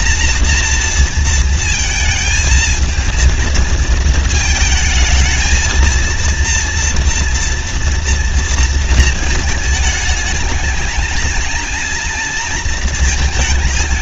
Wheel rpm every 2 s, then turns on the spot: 230, 220, 220, 230, 230, 220, 230.
none